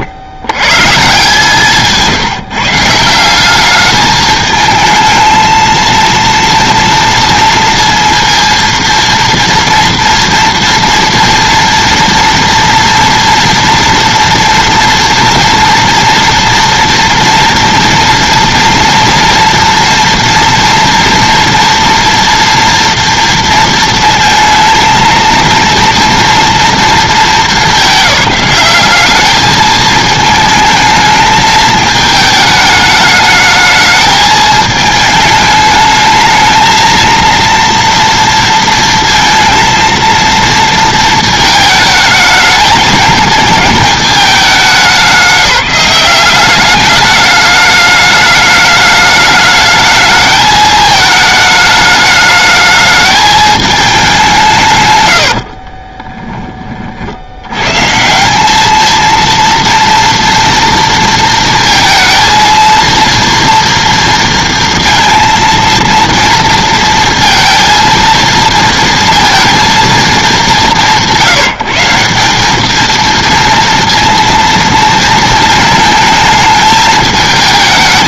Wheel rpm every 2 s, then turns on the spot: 140, 160, 220, 230, 230, 230, 230, 230, 230, 240, 230, 230, 230, 230, 200, 220, 210, 220, 220, 230, 230, 220, 200, 200, 210, 220, 210, 130, 40, 220, 230, 230, 230, 230, 230, 190, 210, 230, 220.
none